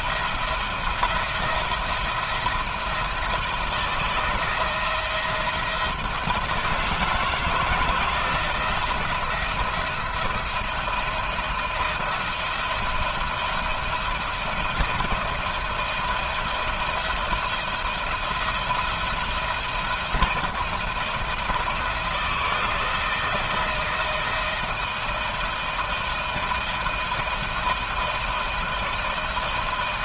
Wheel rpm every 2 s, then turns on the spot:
170, 170, 160, 160, 170, 170, 170, 160, 170, 170, 170, 170, 160, 160, 160.
none